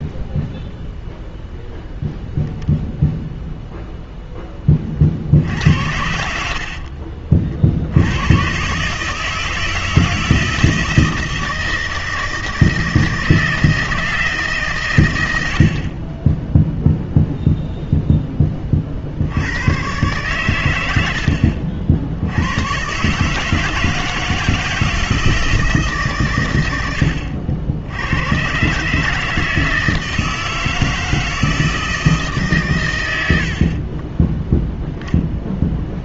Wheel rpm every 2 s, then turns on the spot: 0, 0, 20, 50, 130, 160, 160, 160, 10, 30, 110, 100, 160, 110, 130, 160, 140, 10.
6-8